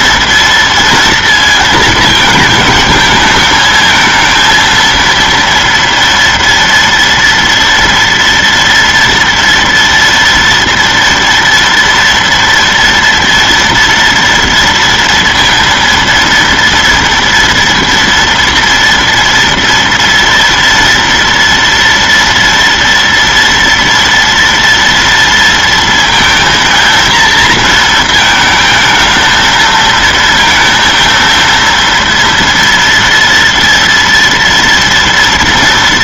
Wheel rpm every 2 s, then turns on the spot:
230, 220, 230, 230, 230, 230, 230, 230, 230, 230, 230, 230, 230, 230, 220, 230, 230, 230.
none